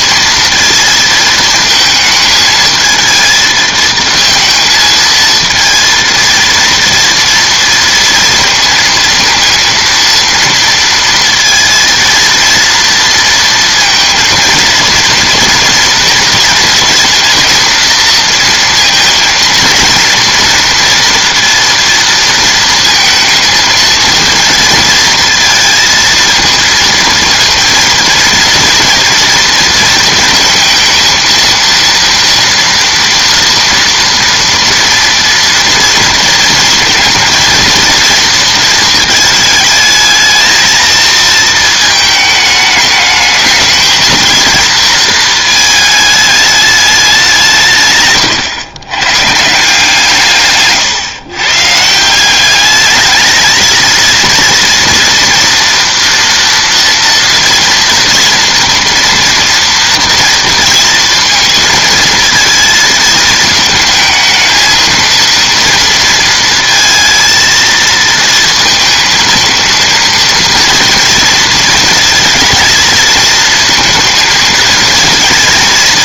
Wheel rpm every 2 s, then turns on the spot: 230, 220, 220, 230, 230, 230, 230, 230, 230, 230, 240, 230, 230, 230, 230, 230, 230, 230, 230, 230, 220, 210, 220, 210, 120, 140, 200, 230, 230, 230, 230, 230, 220, 230, 230, 230, 220, 220.
none